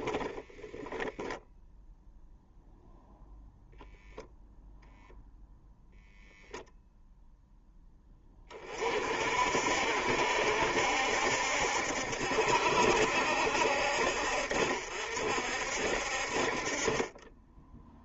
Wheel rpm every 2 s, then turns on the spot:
10, 0, 0, 0, 50, 70, 60, 60, 30.
none